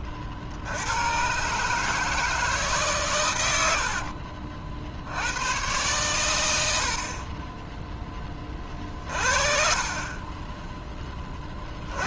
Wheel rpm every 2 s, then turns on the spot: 80, 150, 60, 90, 30, 10.
none